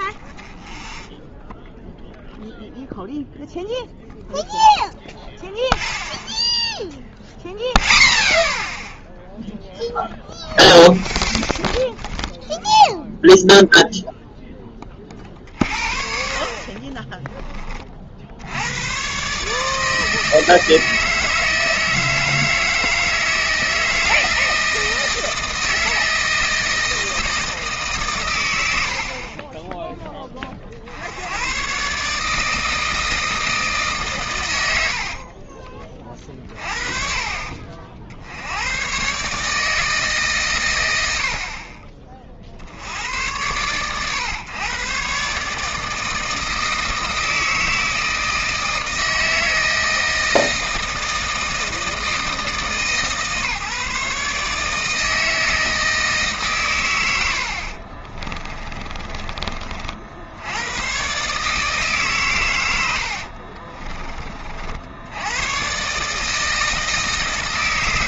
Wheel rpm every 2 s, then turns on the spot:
0, 0, 0, 0, 0, 0, 0, 20, 40, 90, 160, 160, 160, 160, 100, 30, 160, 100, 40, 90, 120, 30, 120, 160, 160, 160, 150, 150, 120, 20, 100, 110, 50, 160.
36-38 58-60